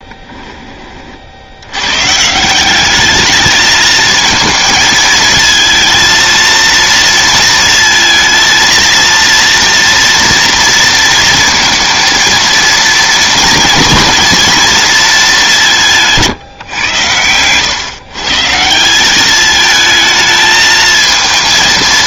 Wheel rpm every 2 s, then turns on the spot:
30, 190, 220, 230, 230, 230, 220, 220, 120, 170, 220.
none